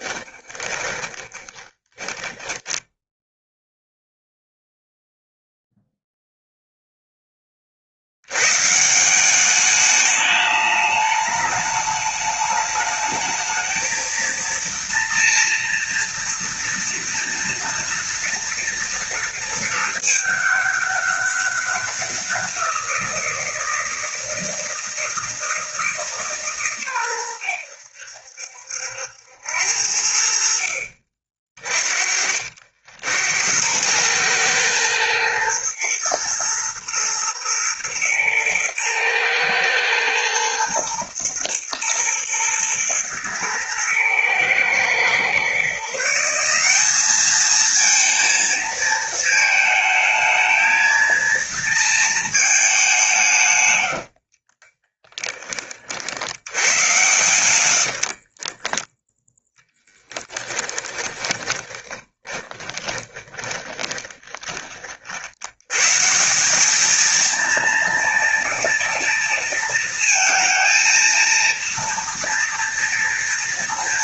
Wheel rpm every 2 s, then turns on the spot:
20, 10, 0, 10, 170, 210, 220, 230, 230, 230, 200, 170, 160, 120, 80, 50, 80, 110, 110, 110, 120, 110, 120, 200, 220, 230, 170, 20, 100, 10, 20, 10, 60, 220, 230, 230, 230.
0-2 54-58 60-64